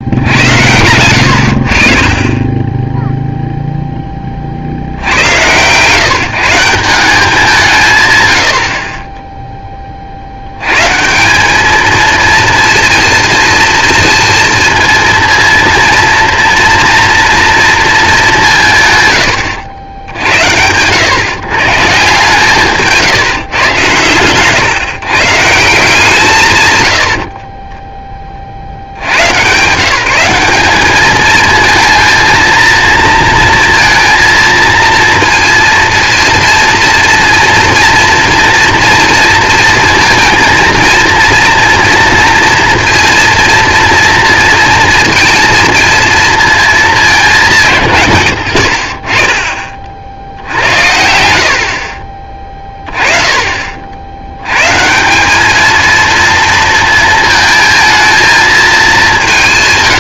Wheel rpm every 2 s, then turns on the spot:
90, 10, 60, 180, 60, 100, 230, 230, 230, 160, 90, 160, 140, 110, 60, 200, 230, 230, 230, 230, 230, 230, 230, 230, 60, 70, 20, 130, 230, 220.
none